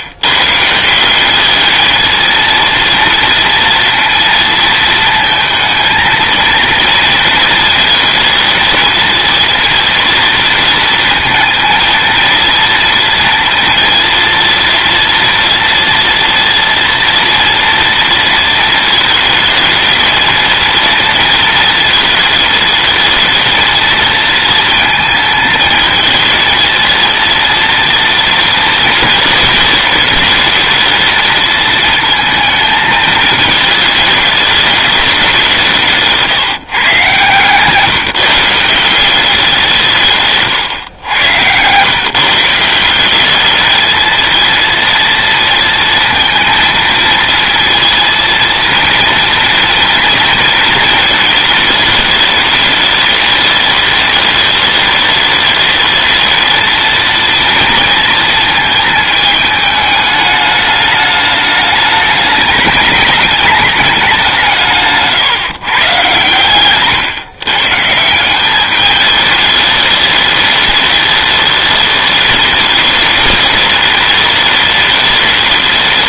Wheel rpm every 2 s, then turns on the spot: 160, 230, 230, 230, 230, 230, 230, 230, 230, 230, 230, 220, 230, 230, 220, 220, 220, 210, 140, 180, 120, 180, 230, 230, 230, 220, 210, 210, 230, 220, 210, 210, 160, 140, 210, 210, 210, 210.
40-42 64-66